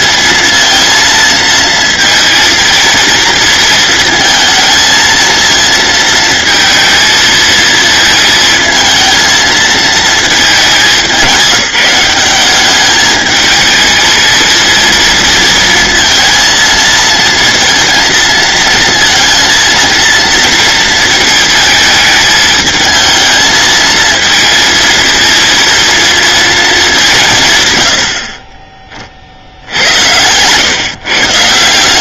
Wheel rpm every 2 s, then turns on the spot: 230, 230, 230, 230, 220, 210, 200, 230, 230, 230, 230, 220, 230, 210, 30, 130.
none